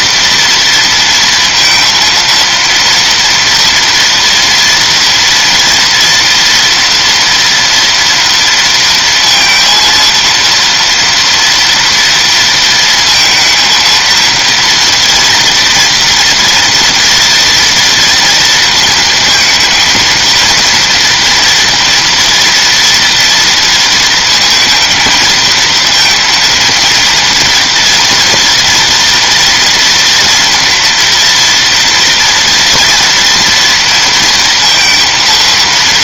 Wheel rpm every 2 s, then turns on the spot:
230, 230, 230, 230, 230, 230, 230, 230, 230, 230, 230, 230, 230, 230, 230, 230, 240, 230.
none